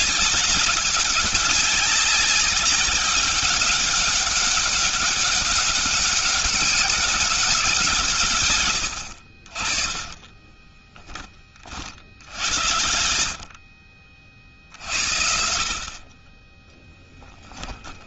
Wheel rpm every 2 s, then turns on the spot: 200, 200, 200, 190, 130, 20, 90, 50, 20.
8-12